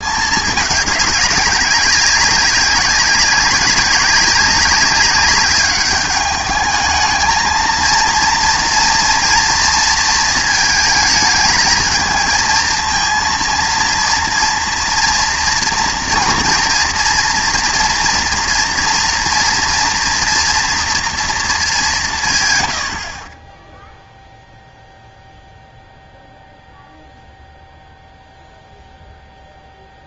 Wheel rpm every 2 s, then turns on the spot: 210, 190, 190, 210, 230, 220, 230, 230, 230, 230, 240, 100, 0, 0, 0.
none